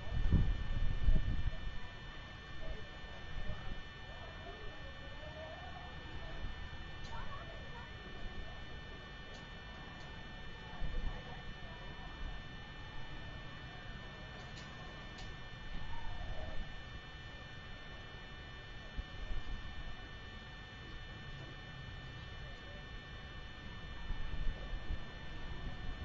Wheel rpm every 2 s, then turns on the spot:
0, 0, 0, 0, 0, 0, 0, 0, 0, 0, 0, 0, 0.
none